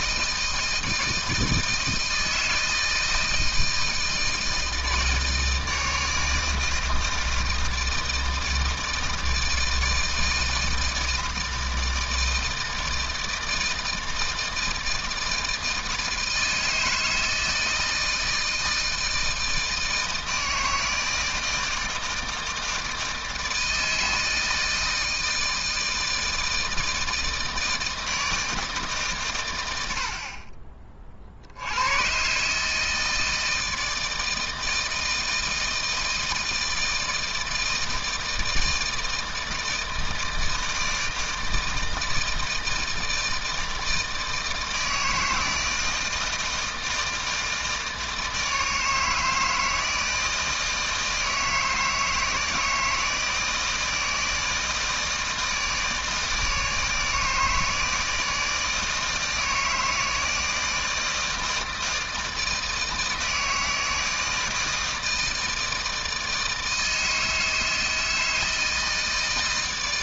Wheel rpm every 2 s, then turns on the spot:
160, 160, 160, 160, 160, 160, 160, 160, 160, 160, 160, 160, 160, 160, 150, 40, 160, 160, 160, 160, 160, 160, 160, 160, 160, 160, 160, 160, 160, 160, 160, 160, 160, 160, 160.
none